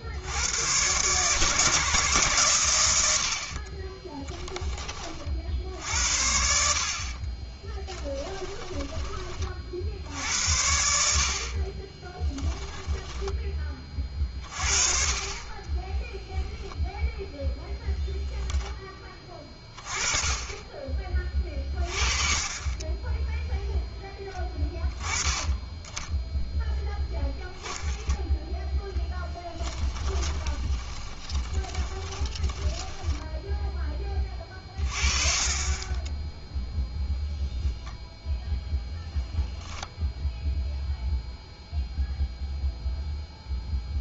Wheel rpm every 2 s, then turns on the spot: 120, 110, 20, 60, 20, 80, 10, 30, 0, 10, 20, 20, 20, 0, 10, 20, 10, 30, 0, 0, 0, 0.
8-10 12-14 30-34